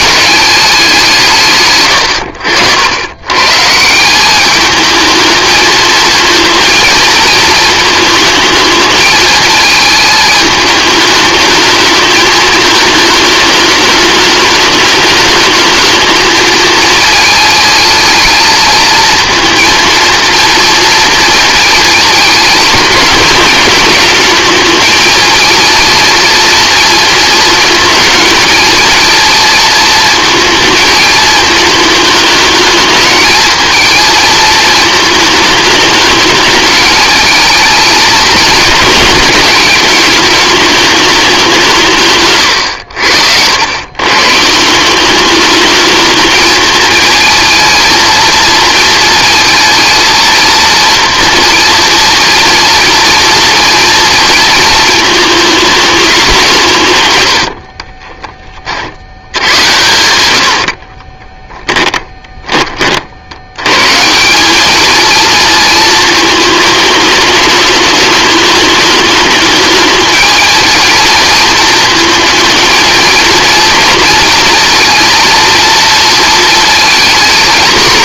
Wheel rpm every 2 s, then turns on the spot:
200, 90, 210, 230, 220, 210, 220, 210, 220, 220, 230, 210, 230, 230, 230, 220, 220, 220, 210, 210, 210, 90, 170, 220, 230, 230, 230, 220, 140, 50, 50, 30, 220, 210, 210, 230, 230, 230, 230.
42-44 60-62